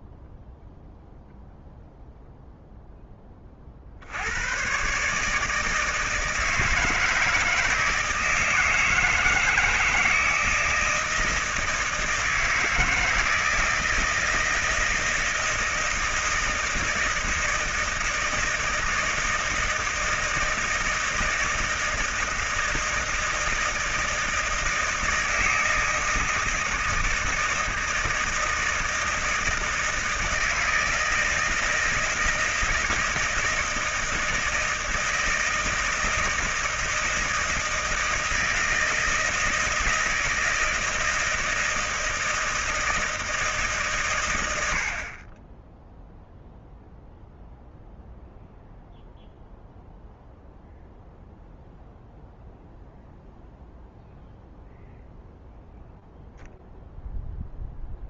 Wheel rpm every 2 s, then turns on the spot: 0, 0, 110, 160, 160, 160, 160, 160, 160, 160, 160, 160, 160, 160, 160, 160, 160, 160, 170, 160, 160, 160, 90, 0, 0, 0, 0, 0, 0.
none